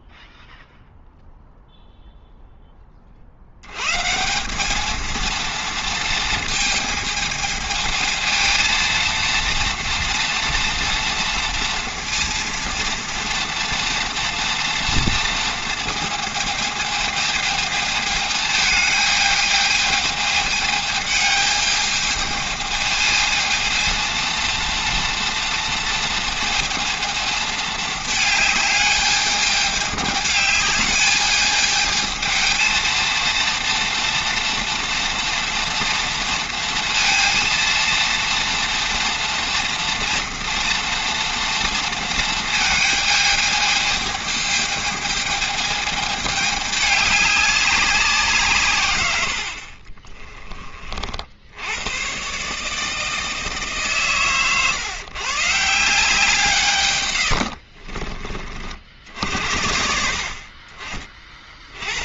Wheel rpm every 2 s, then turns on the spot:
0, 40, 220, 220, 230, 230, 230, 230, 220, 220, 220, 220, 230, 220, 210, 210, 220, 230, 230, 230, 230, 220, 220, 200, 110, 40, 160, 140, 120, 60, 30.
none